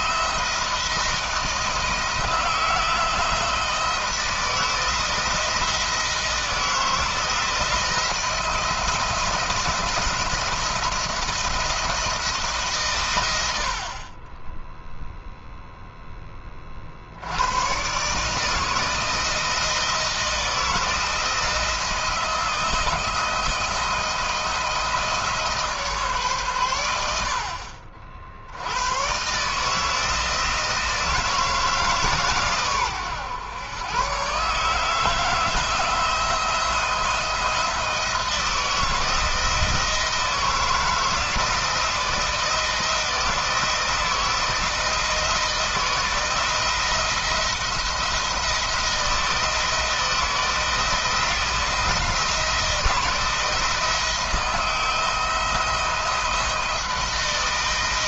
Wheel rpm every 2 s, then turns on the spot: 170, 160, 160, 160, 170, 170, 120, 0, 50, 160, 160, 160, 160, 90, 100, 160, 120, 150, 170, 160, 160, 170, 170, 170, 170, 170, 170, 160, 160.
none